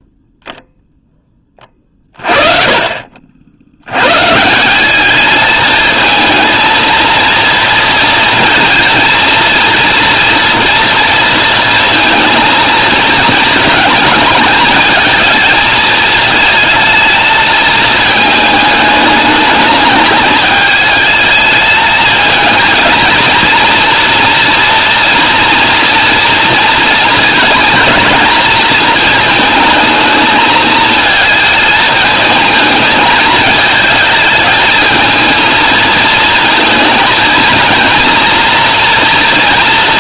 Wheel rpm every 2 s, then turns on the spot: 0, 50, 200, 230, 230, 230, 230, 220, 220, 210, 220, 230, 230, 230, 220, 220, 220, 220, 220, 230.
none